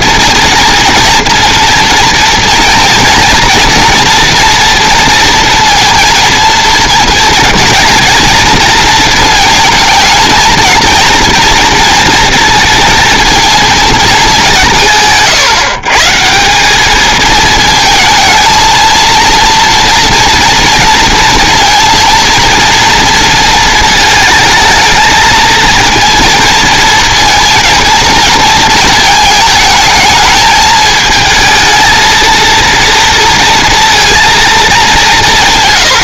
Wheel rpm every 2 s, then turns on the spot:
240, 230, 230, 230, 230, 230, 230, 160, 200, 230, 230, 230, 220, 230, 220, 220, 230, 200.
none